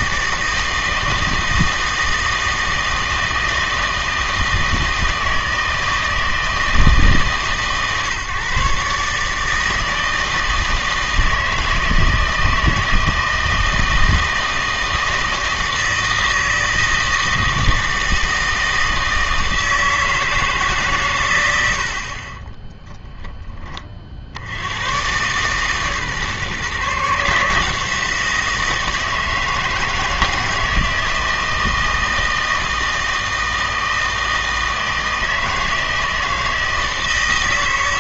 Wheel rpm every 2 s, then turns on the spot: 160, 160, 160, 160, 140, 160, 160, 160, 160, 160, 140, 10, 90, 150, 160, 160, 160, 160, 160.
22-24